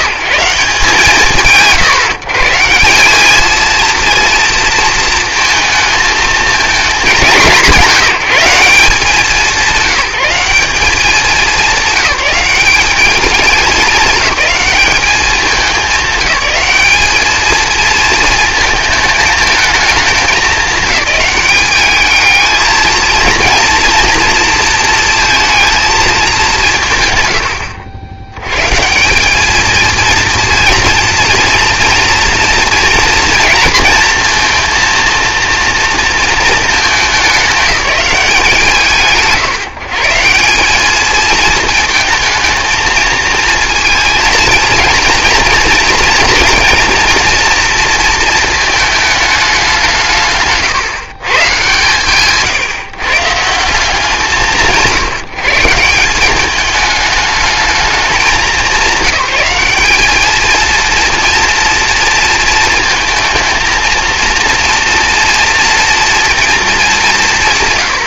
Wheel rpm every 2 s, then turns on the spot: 150, 170, 230, 210, 180, 190, 200, 210, 210, 220, 190, 230, 230, 170, 120, 230, 230, 230, 220, 150, 190, 220, 230, 230, 220, 140, 150, 160, 210, 190, 230, 230, 230, 220.
none